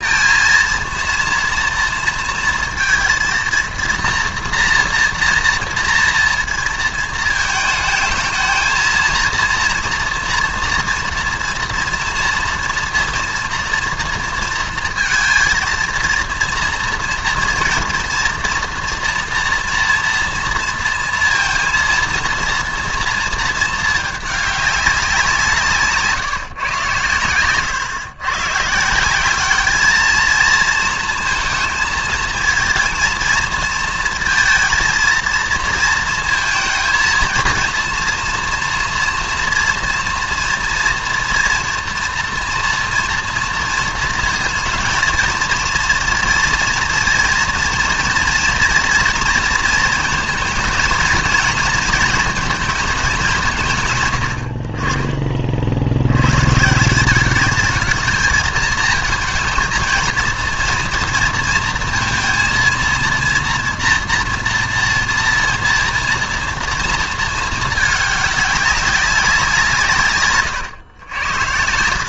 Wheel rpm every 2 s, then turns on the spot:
230, 230, 230, 230, 220, 230, 230, 230, 230, 230, 230, 230, 200, 130, 140, 230, 230, 230, 230, 240, 230, 230, 230, 230, 240, 220, 220, 50, 150, 220, 230, 230, 230, 230, 200, 120.
none